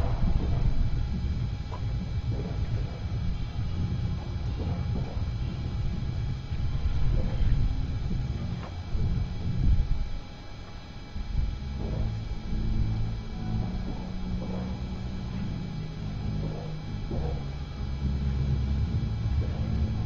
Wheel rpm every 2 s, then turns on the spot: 0, 0, 0, 0, 0, 0, 0, 0, 0, 0.
none